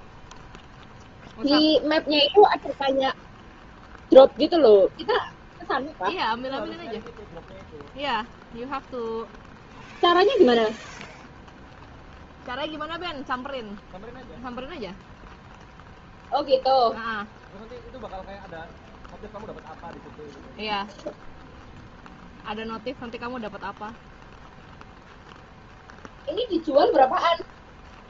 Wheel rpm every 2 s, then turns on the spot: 0, 0, 0, 0, 0, 0, 0, 0, 0, 0, 0, 0, 0, 0.
none